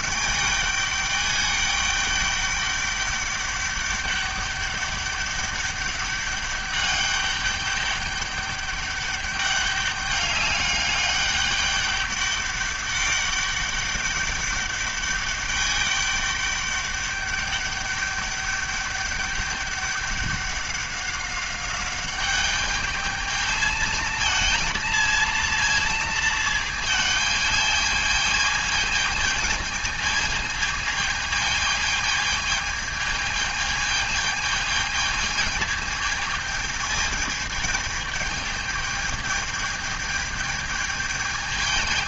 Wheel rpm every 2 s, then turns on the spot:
200, 200, 200, 200, 200, 200, 200, 200, 200, 200, 200, 210, 230, 220, 220, 220, 220, 220, 220, 210, 210.
none